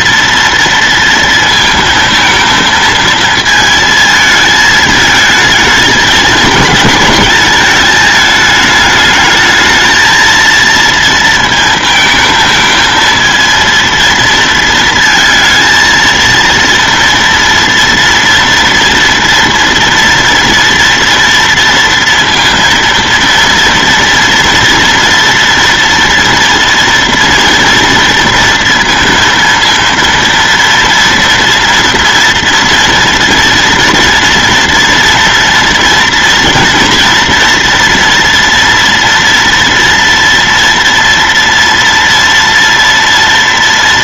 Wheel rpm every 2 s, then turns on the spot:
230, 230, 220, 220, 210, 230, 220, 230, 230, 230, 230, 230, 230, 240, 230, 230, 230, 230, 230, 230, 230, 230.
none